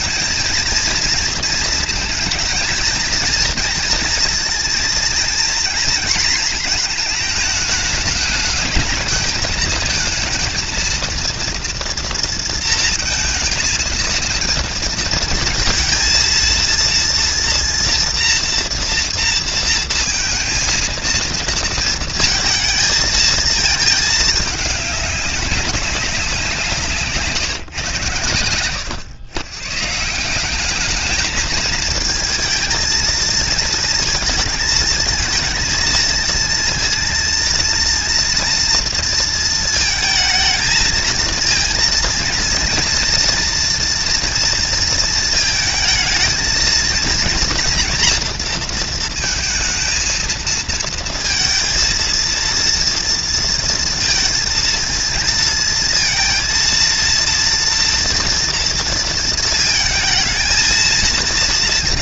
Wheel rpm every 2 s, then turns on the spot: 230, 220, 230, 230, 210, 220, 230, 230, 230, 240, 230, 230, 220, 190, 110, 170, 230, 230, 230, 230, 230, 230, 230, 220, 240, 230, 230, 230, 230, 230, 220.
none